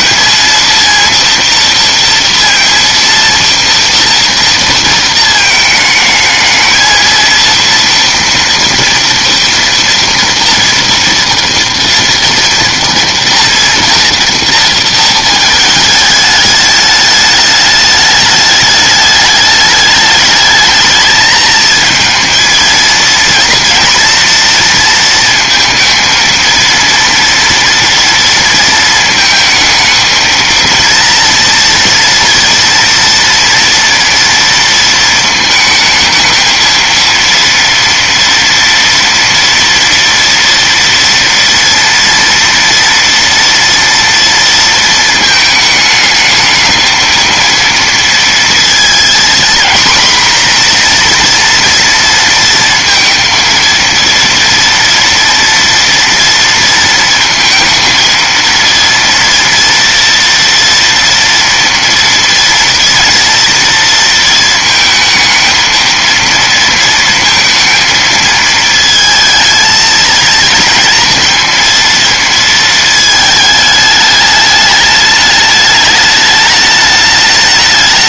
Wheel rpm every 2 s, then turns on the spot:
230, 230, 230, 220, 230, 240, 240, 230, 210, 210, 220, 230, 230, 230, 230, 230, 230, 230, 220, 230, 230, 230, 230, 220, 230, 240, 230, 230, 230, 230, 230, 230, 230, 230, 220, 230, 220, 210, 210.
none